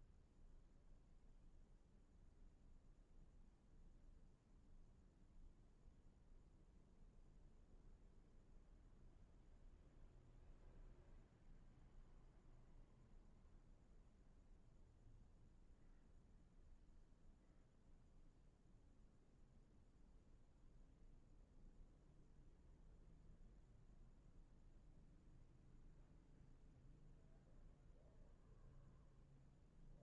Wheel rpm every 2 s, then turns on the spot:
0, 0, 0, 0, 0, 0, 0, 0, 0, 0, 0, 0, 0, 0, 0.
none